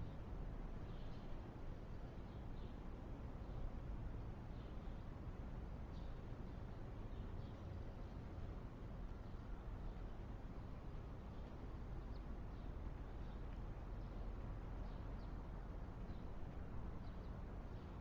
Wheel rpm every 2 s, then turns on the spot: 0, 0, 0, 0, 0, 0, 0, 0, 0.
none